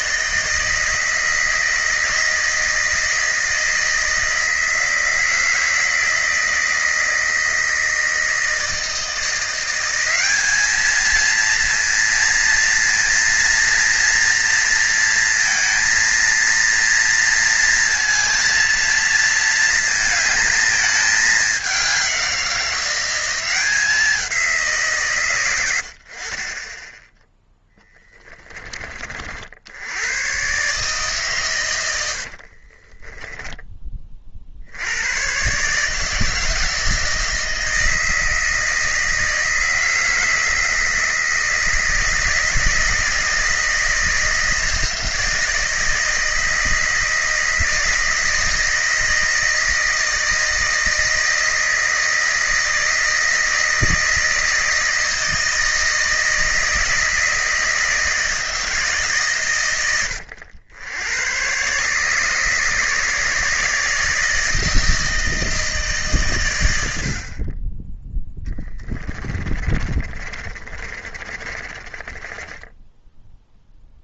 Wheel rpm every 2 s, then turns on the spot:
160, 160, 160, 160, 160, 210, 230, 230, 230, 230, 220, 180, 160, 20, 30, 130, 40, 60, 160, 160, 160, 160, 160, 160, 160, 160, 160, 160, 160, 160, 100, 150, 160, 110, 10, 30, 10.
32-34 68-72